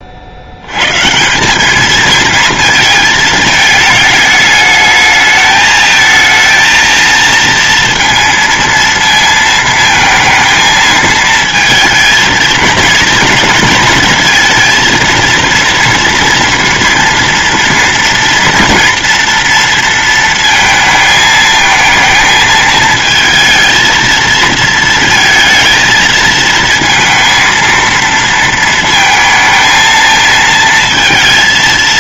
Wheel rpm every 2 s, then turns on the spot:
140, 230, 220, 230, 230, 220, 230, 230, 230, 230, 220, 220, 230, 230, 220, 230.
none